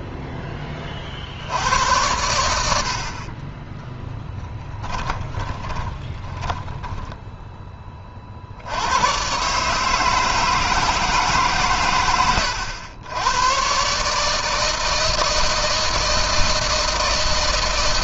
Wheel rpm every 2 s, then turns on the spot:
10, 80, 30, 10, 60, 160, 90, 160, 160.
4-8